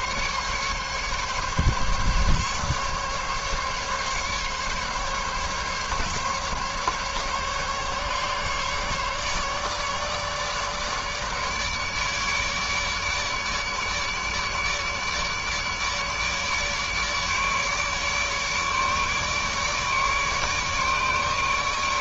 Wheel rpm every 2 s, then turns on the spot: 140, 140, 140, 140, 150, 150, 150, 150, 150, 150, 150.
none